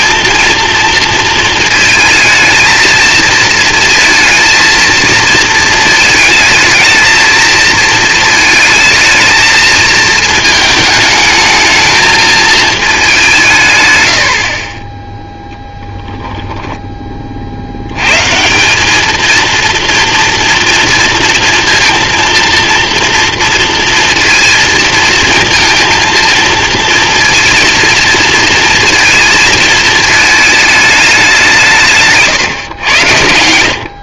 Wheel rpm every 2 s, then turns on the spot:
230, 220, 230, 220, 230, 220, 220, 30, 10, 190, 240, 230, 230, 230, 230, 220, 120.
none